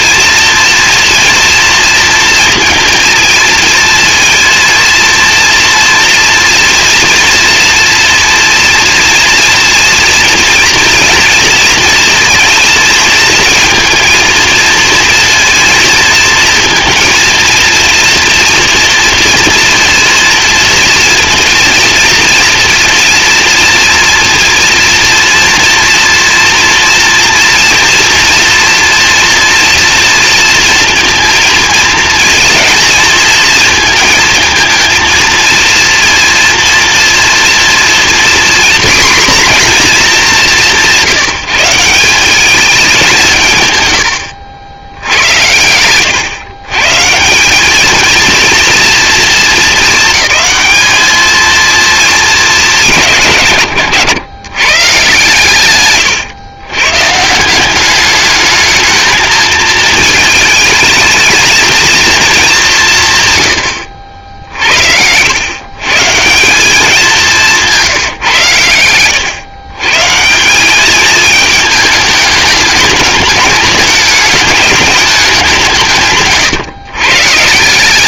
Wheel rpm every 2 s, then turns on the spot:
230, 230, 230, 230, 230, 230, 230, 230, 230, 230, 230, 230, 230, 230, 230, 230, 220, 220, 230, 250, 180, 190, 90, 150, 230, 220, 180, 150, 120, 220, 220, 180, 70, 190, 110, 200, 210, 210, 140.
none